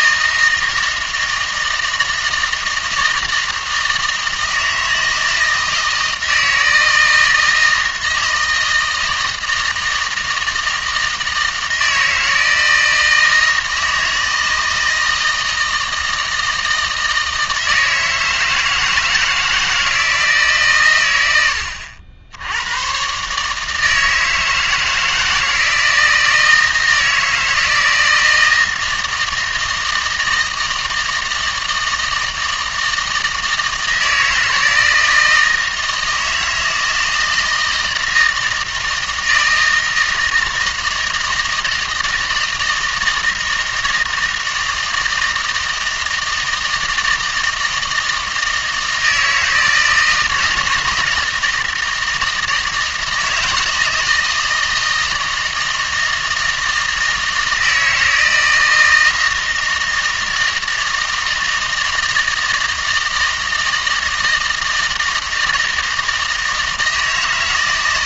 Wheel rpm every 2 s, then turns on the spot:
160, 160, 160, 160, 160, 160, 160, 160, 160, 160, 130, 100, 160, 160, 160, 160, 160, 160, 160, 160, 160, 160, 160, 160, 160, 160, 160, 160, 160, 160, 160, 160, 160, 160.
none